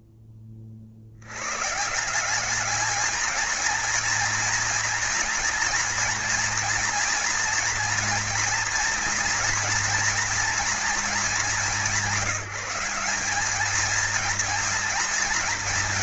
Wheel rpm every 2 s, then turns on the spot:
40, 200, 240, 230, 230, 230, 190, 230.
none